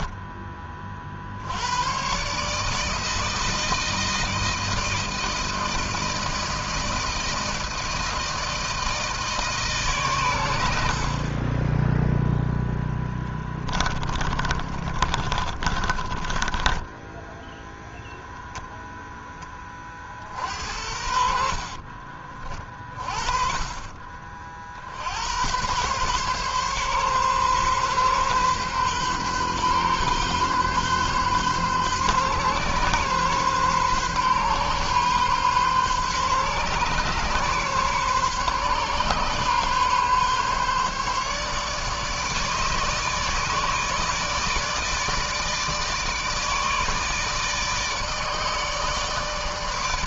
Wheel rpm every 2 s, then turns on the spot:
20, 150, 160, 160, 160, 80, 0, 30, 20, 0, 60, 50, 50, 140, 130, 130, 130, 130, 130, 140, 140, 150, 150, 160, 160.
14-18 20-22